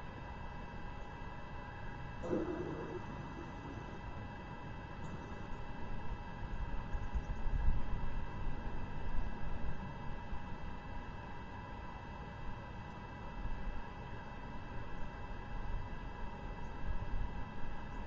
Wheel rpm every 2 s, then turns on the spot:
0, 0, 0, 0, 0, 0, 0, 0, 0.
none